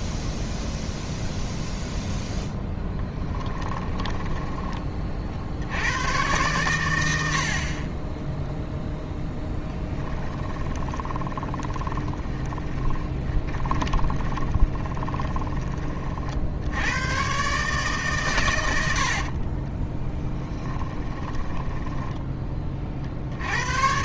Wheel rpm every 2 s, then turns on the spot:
0, 10, 20, 110, 0, 10, 20, 20, 80, 90, 20, 30.
2-4 10-16 20-22